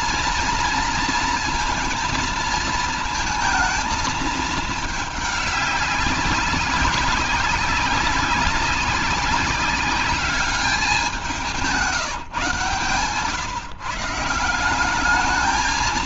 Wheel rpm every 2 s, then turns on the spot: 230, 230, 220, 190, 190, 200, 140, 180.
none